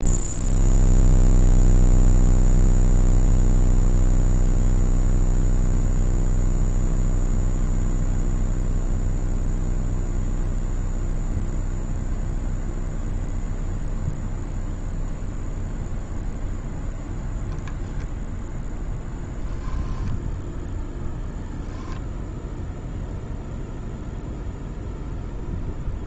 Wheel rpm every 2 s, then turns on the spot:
0, 0, 0, 0, 0, 0, 0, 0, 0, 0, 0, 0, 0.
none